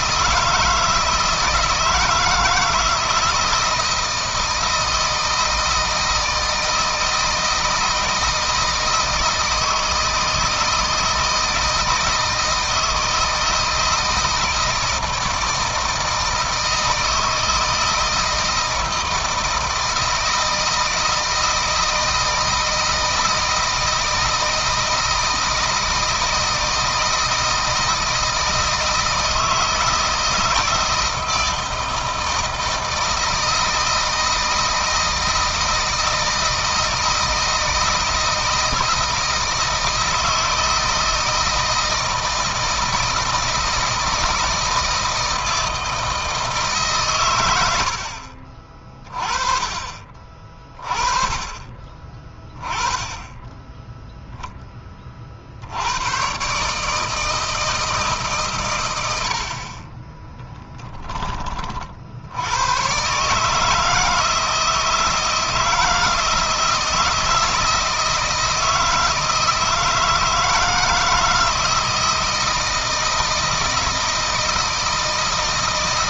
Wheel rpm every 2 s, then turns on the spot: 160, 160, 160, 160, 160, 160, 160, 160, 160, 160, 160, 160, 160, 160, 160, 160, 160, 160, 160, 160, 160, 160, 160, 150, 30, 30, 10, 20, 150, 120, 10, 120, 160, 160, 160, 160, 160, 160.
none